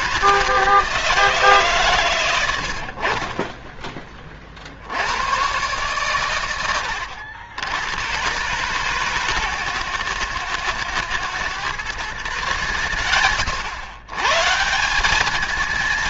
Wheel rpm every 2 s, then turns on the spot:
160, 120, 20, 120, 110, 120, 140, 130.
none